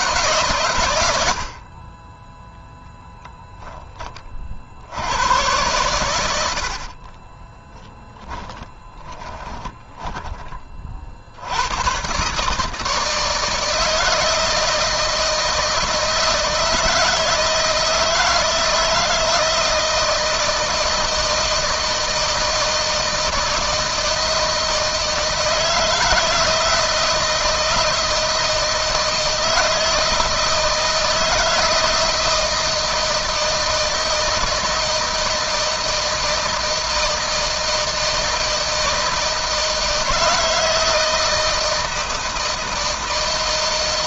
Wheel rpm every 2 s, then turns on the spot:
110, 10, 90, 50, 30, 40, 150, 160, 160, 160, 160, 160, 160, 160, 160, 160, 160, 160, 160, 160, 160, 160.
8-10